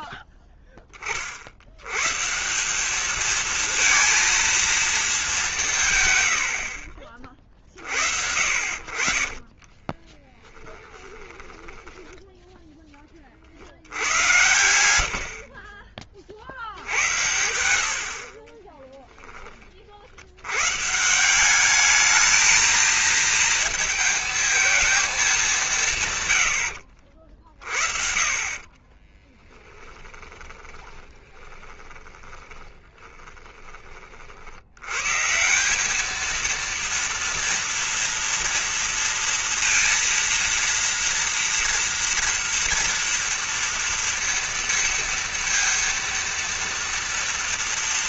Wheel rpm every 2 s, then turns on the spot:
0, 170, 230, 70, 50, 10, 10, 100, 60, 30, 100, 220, 220, 110, 30, 10, 10, 60, 230, 230, 230, 230, 230, 230.
10-12 14-16 28-34